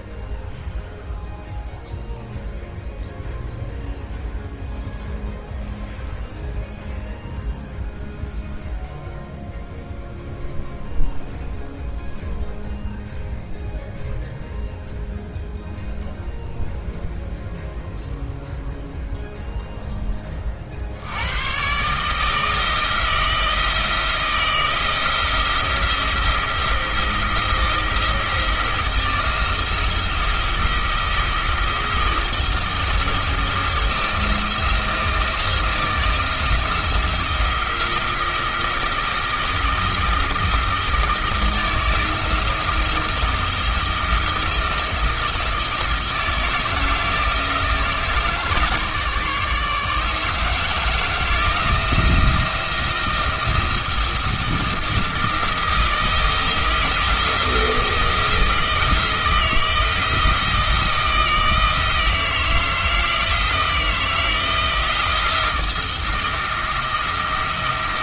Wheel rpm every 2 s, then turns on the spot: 0, 0, 0, 0, 0, 0, 0, 0, 0, 0, 60, 160, 160, 170, 160, 170, 170, 170, 170, 170, 160, 170, 170, 160, 150, 160, 170, 170, 160, 160, 160, 160, 160, 170.
none